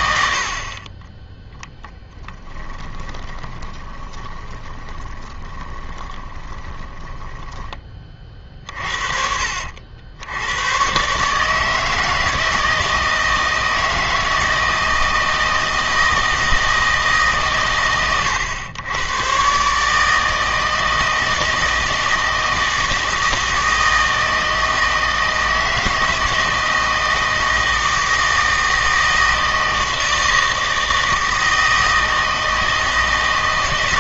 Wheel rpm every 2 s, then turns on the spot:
50, 20, 20, 20, 50, 110, 160, 160, 160, 100, 160, 160, 160, 160, 160, 160, 160.
2-8